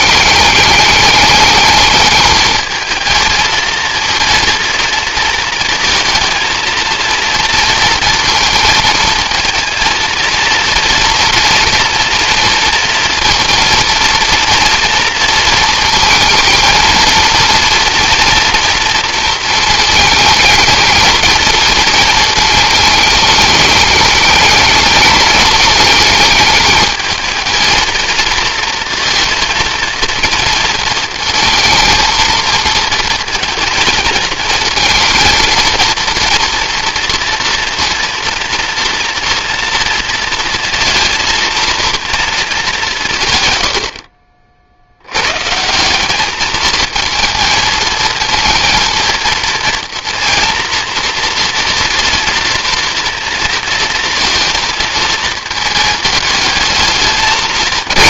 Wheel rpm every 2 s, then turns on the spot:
210, 220, 230, 230, 220, 230, 230, 230, 220, 230, 220, 220, 210, 220, 230, 220, 220, 220, 230, 230, 230, 190, 50, 220, 230, 230, 230, 230, 210.
none